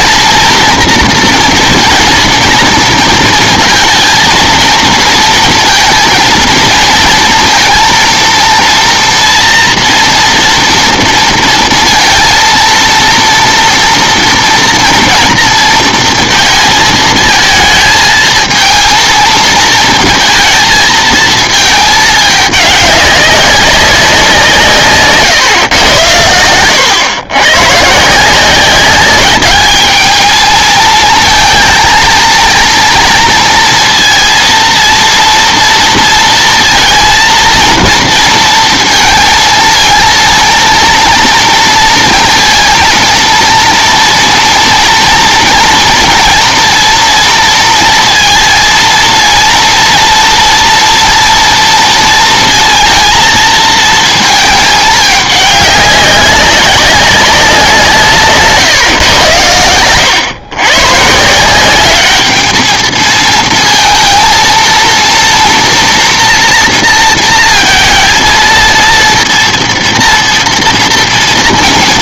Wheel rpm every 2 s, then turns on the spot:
240, 230, 220, 230, 230, 240, 230, 230, 220, 230, 230, 200, 170, 100, 180, 220, 230, 230, 230, 230, 230, 230, 230, 240, 230, 230, 230, 220, 200, 150, 120, 210, 230, 230, 230, 230.
none